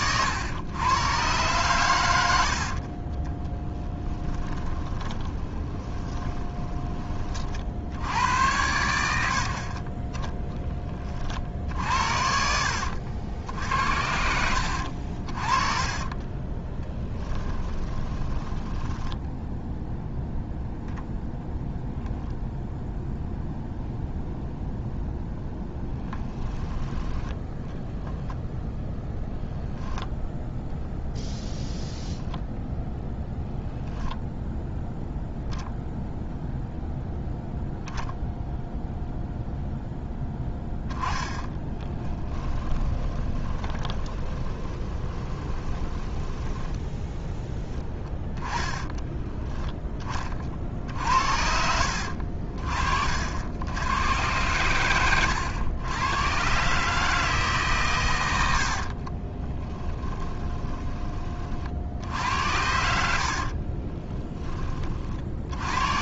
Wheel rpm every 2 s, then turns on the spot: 110, 50, 20, 20, 100, 20, 70, 60, 10, 10, 0, 0, 0, 10, 0, 0, 0, 0, 0, 0, 10, 20, 10, 10, 10, 50, 50, 100, 140, 70, 20, 80, 30.
2-6 12-14 16-20 42-50 58-60 62-64